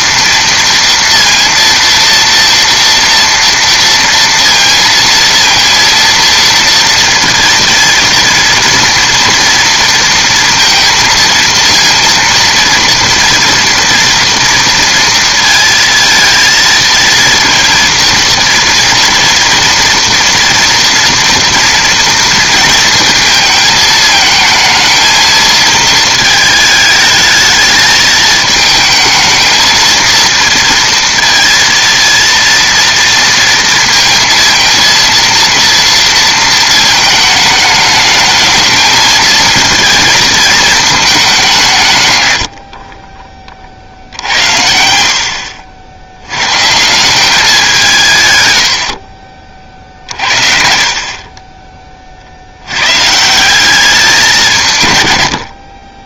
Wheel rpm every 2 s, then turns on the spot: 230, 230, 230, 230, 240, 230, 230, 230, 230, 240, 230, 230, 220, 220, 220, 230, 230, 230, 220, 220, 220, 60, 80, 140, 90, 50, 90, 150.
none